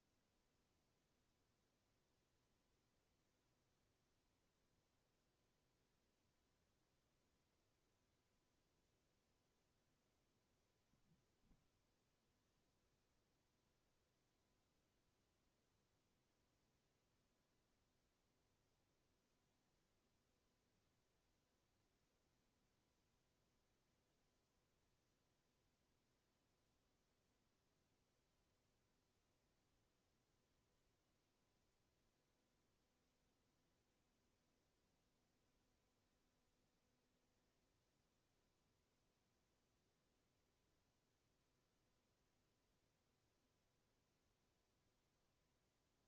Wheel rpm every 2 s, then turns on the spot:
0, 0, 0, 0, 0, 0, 0, 0, 0, 0, 0, 0, 0, 0, 0, 0, 0, 0, 0, 0, 0, 0, 0.
none